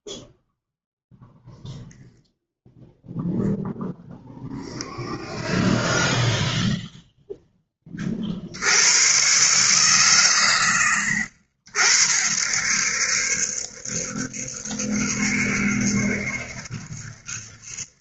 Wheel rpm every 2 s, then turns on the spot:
0, 0, 0, 0, 50, 130, 70, 70, 70.
none